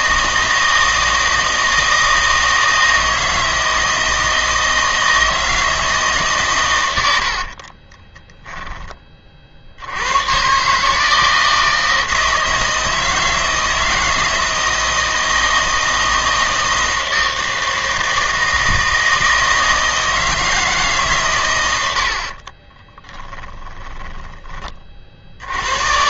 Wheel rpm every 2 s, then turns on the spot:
160, 160, 160, 110, 20, 140, 160, 160, 160, 160, 160, 30, 20.
8-10 22-24